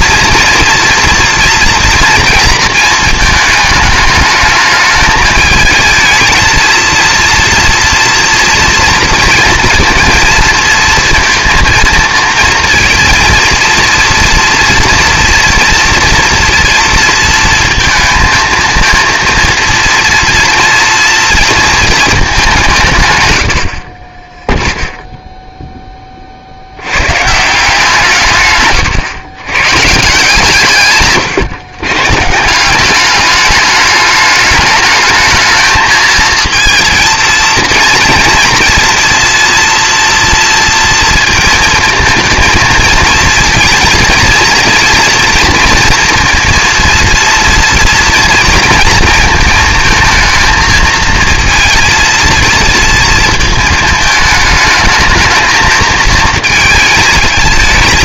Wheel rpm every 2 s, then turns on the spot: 230, 230, 210, 230, 230, 230, 230, 230, 240, 230, 230, 170, 0, 80, 120, 140, 190, 210, 230, 230, 230, 230, 230, 230, 230, 230, 230, 220, 220.
none